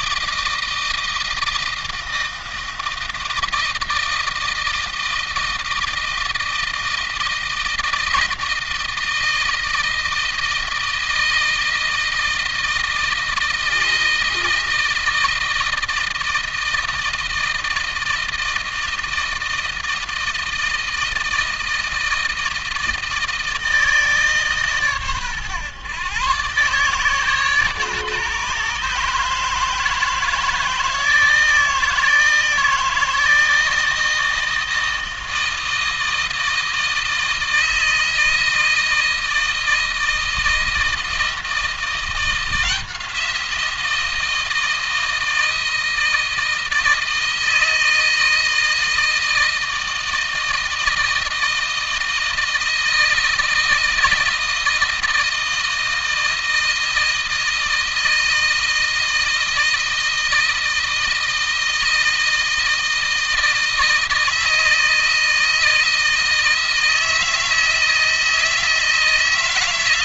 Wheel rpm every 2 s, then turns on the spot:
160, 160, 160, 160, 160, 160, 160, 160, 160, 160, 160, 160, 140, 130, 150, 160, 160, 160, 160, 160, 160, 170, 160, 160, 160, 160, 160, 160, 160, 160, 160, 160, 160, 160, 160.
none